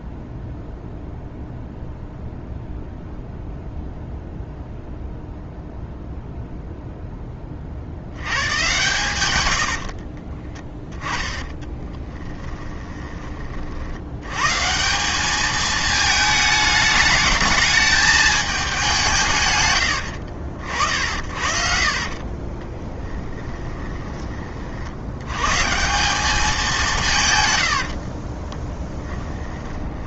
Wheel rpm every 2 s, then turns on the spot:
0, 0, 0, 0, 120, 10, 10, 160, 210, 200, 60, 20, 60, 180, 20.
12-14 22-24 28-30